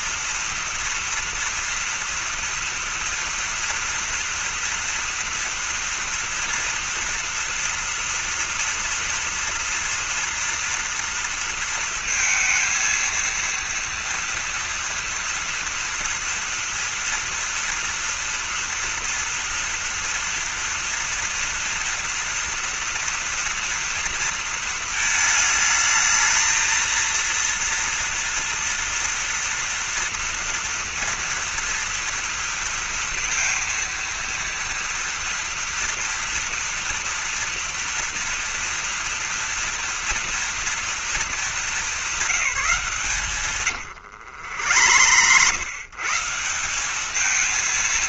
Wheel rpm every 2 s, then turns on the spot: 230, 230, 230, 230, 240, 240, 230, 230, 230, 230, 230, 230, 230, 220, 230, 230, 230, 230, 230, 230, 230, 180, 90, 180.
44-46